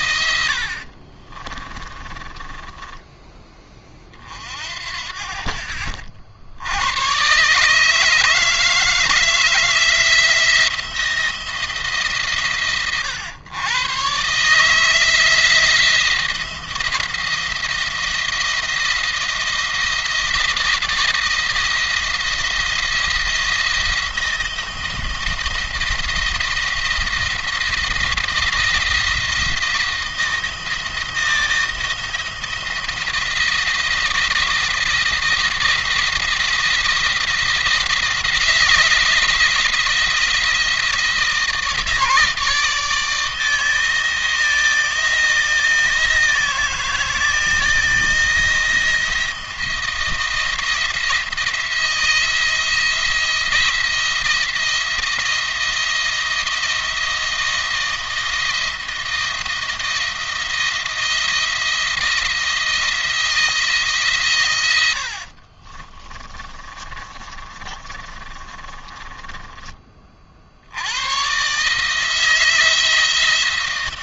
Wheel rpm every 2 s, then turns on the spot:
70, 20, 50, 80, 160, 160, 120, 150, 170, 160, 170, 170, 170, 170, 170, 160, 160, 160, 170, 170, 170, 160, 160, 160, 170, 170, 170, 170, 170, 170, 170, 170, 110, 30, 30, 70, 170.
0-4 66-70